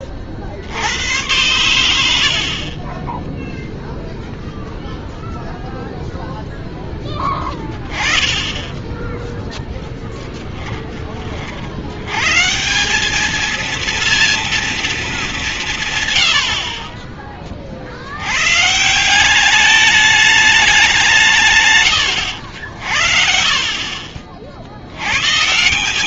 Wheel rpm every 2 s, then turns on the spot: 50, 40, 0, 0, 10, 20, 140, 230, 70, 110, 210, 90, 60.
8-12